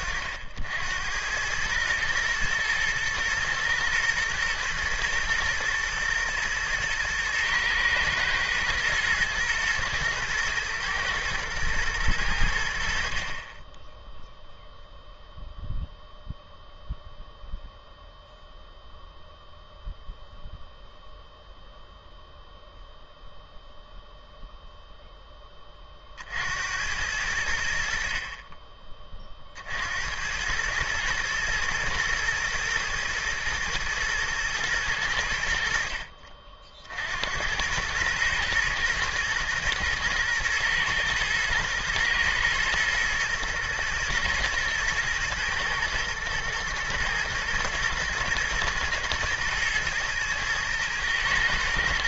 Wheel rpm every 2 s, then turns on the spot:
60, 110, 120, 120, 110, 120, 60, 0, 0, 0, 0, 0, 0, 90, 30, 110, 110, 110, 60, 120, 110, 110, 110, 110, 110, 110.
none